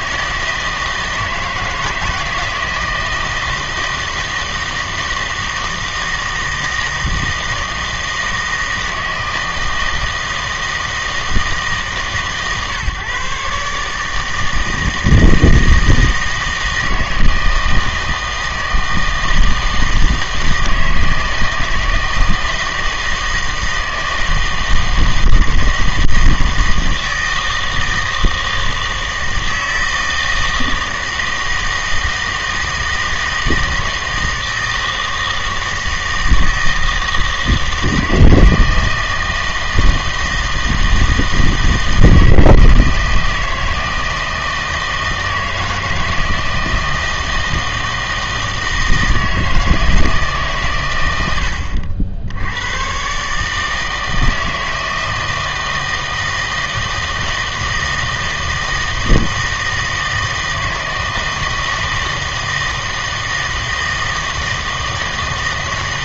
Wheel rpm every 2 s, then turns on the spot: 160, 160, 160, 160, 160, 160, 140, 160, 160, 160, 160, 160, 160, 160, 160, 160, 160, 160, 160, 160, 160, 160, 160, 160, 160, 130, 100, 160, 160, 160, 160, 160, 160.
none